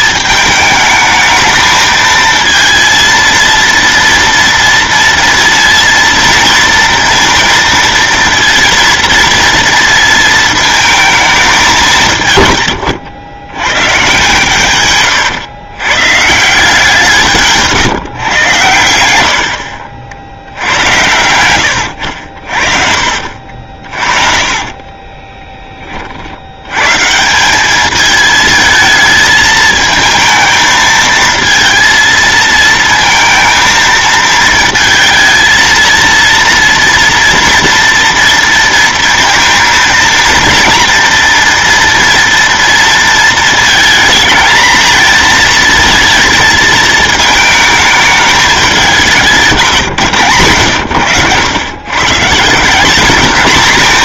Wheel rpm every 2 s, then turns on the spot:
210, 230, 230, 230, 230, 220, 130, 140, 160, 110, 70, 60, 30, 90, 220, 220, 230, 220, 230, 230, 230, 230, 220, 220, 200, 120, 170.
24-26